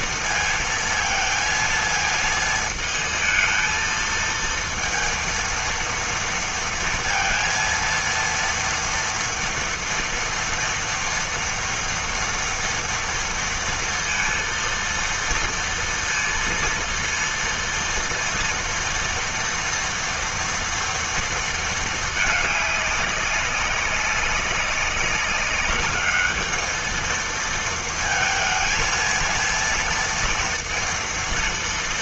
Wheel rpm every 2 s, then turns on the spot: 230, 220, 230, 230, 230, 230, 230, 230, 230, 230, 230, 210, 190, 210, 230, 230.
none